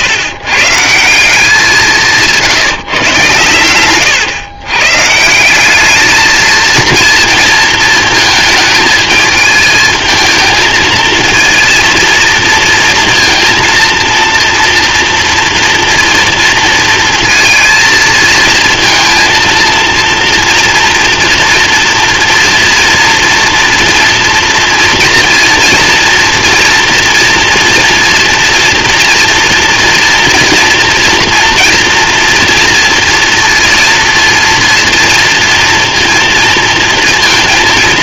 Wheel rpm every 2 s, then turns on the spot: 140, 160, 120, 220, 220, 220, 230, 230, 230, 220, 230, 240, 230, 230, 230, 240, 230, 230, 230.
none